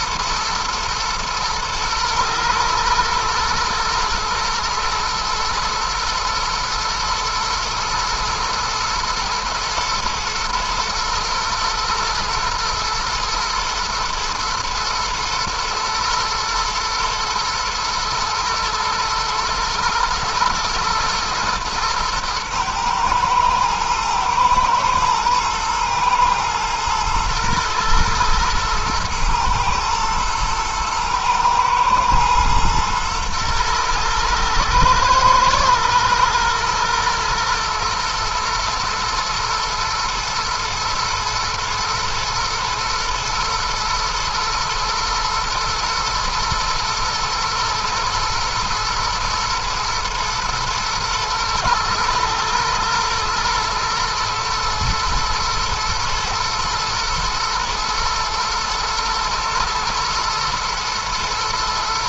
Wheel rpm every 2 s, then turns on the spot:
110, 120, 120, 110, 110, 110, 120, 110, 120, 110, 120, 110, 120, 120, 120, 110, 110, 110, 120, 110, 120, 120, 120, 110, 110, 110, 120, 110, 120, 110, 120.
none